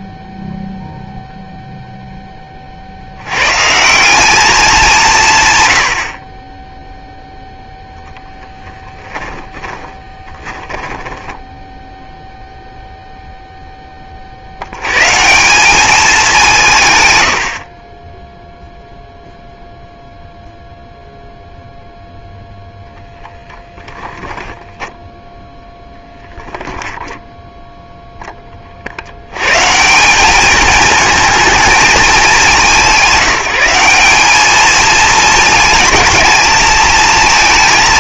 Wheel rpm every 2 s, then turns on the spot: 0, 50, 190, 10, 20, 10, 0, 180, 80, 0, 0, 10, 0, 10, 200, 200, 200, 220, 220.
8-12